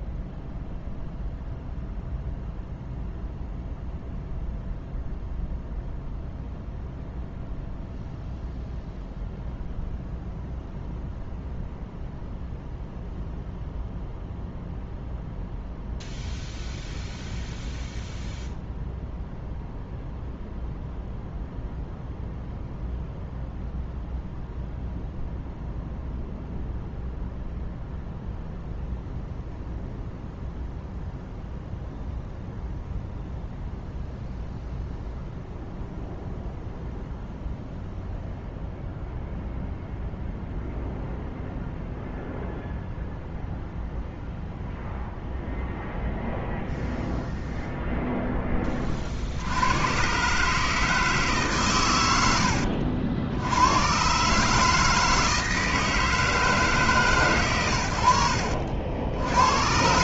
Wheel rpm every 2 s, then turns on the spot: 0, 0, 0, 0, 0, 0, 0, 0, 0, 0, 0, 0, 0, 0, 0, 0, 0, 0, 0, 0, 0, 0, 0, 0, 50, 160, 80, 160, 150, 70.
none